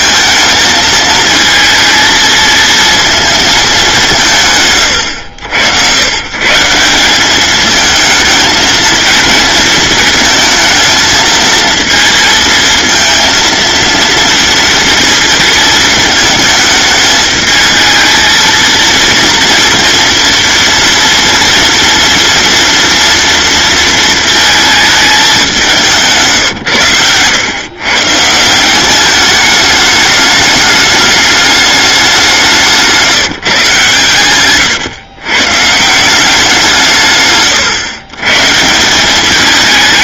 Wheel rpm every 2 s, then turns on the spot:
220, 230, 150, 160, 220, 220, 220, 230, 220, 230, 230, 230, 220, 130, 170, 210, 180, 120, 180, 150.
none